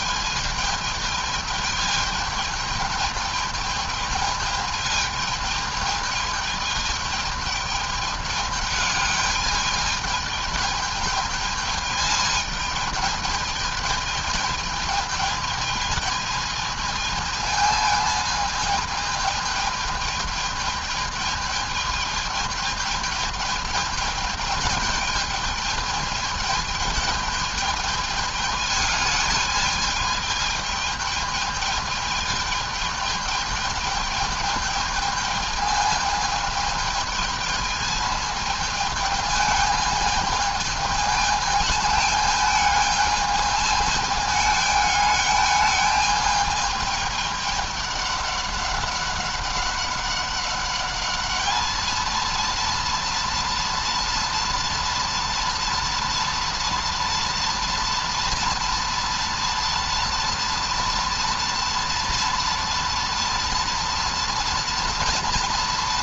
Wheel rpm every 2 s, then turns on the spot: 220, 210, 220, 210, 210, 210, 220, 210, 220, 220, 210, 210, 210, 210, 210, 210, 210, 210, 210, 220, 220, 210, 210, 210, 200, 200, 230, 230, 230, 240, 230, 230, 230.
none